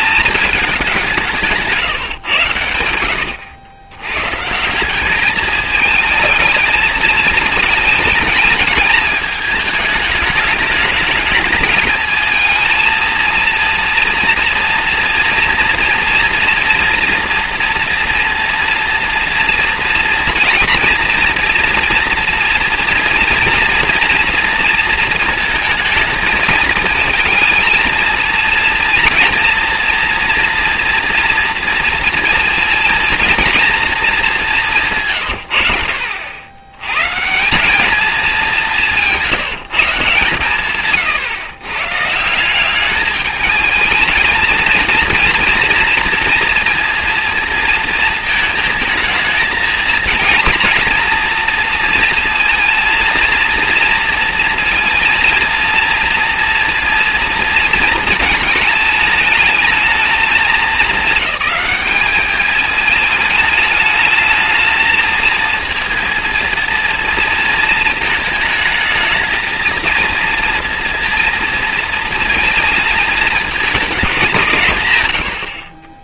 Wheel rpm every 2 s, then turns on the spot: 180, 90, 200, 220, 210, 210, 230, 240, 230, 230, 240, 230, 230, 230, 230, 230, 230, 150, 140, 170, 130, 210, 230, 230, 220, 230, 230, 230, 230, 210, 210, 210, 220, 230, 220, 230, 220, 120.
38-40 74-76